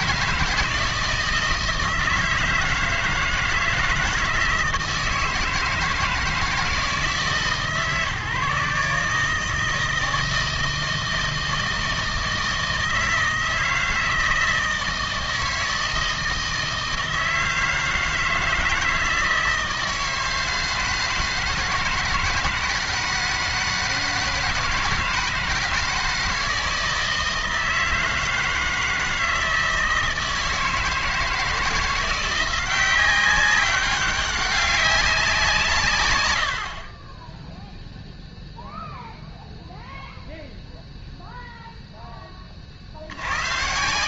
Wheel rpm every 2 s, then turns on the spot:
160, 160, 160, 160, 140, 160, 160, 160, 160, 160, 160, 160, 160, 160, 160, 160, 180, 200, 60, 0, 0, 40.
none